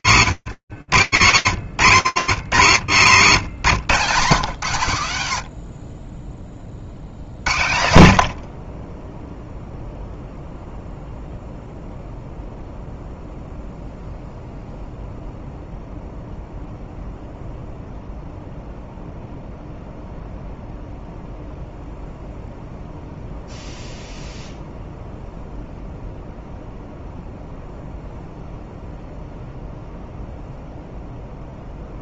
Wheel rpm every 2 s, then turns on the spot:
120, 80, 50, 20, 0, 0, 0, 0, 0, 0, 0, 0, 0, 0, 0, 0.
none